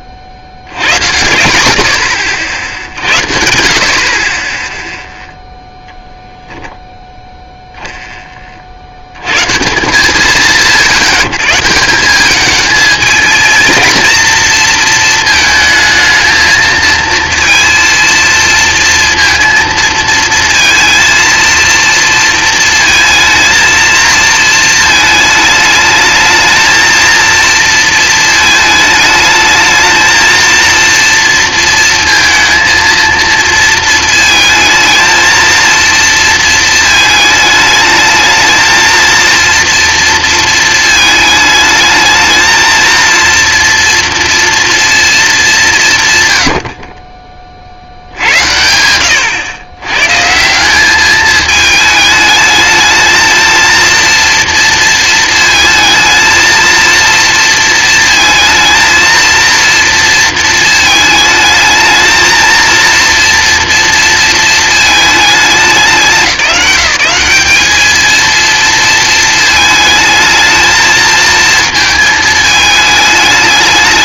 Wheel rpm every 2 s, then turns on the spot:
90, 70, 10, 0, 70, 140, 210, 230, 220, 230, 230, 230, 220, 220, 220, 230, 230, 220, 220, 220, 220, 220, 230, 60, 100, 190, 220, 230, 230, 220, 220, 230, 230, 180, 230, 220, 220.
none